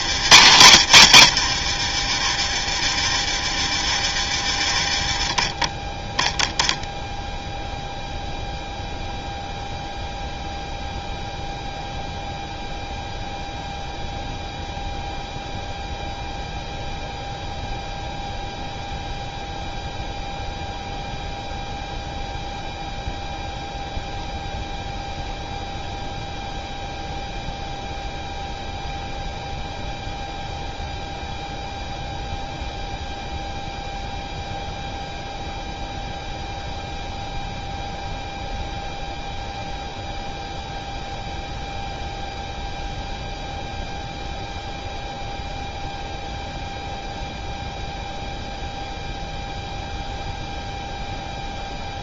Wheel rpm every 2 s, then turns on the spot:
90, 40, 30, 0, 0, 0, 0, 0, 0, 0, 0, 0, 0, 0, 0, 0, 0, 0, 0, 0, 0, 0, 0, 0, 0, 0.
0-2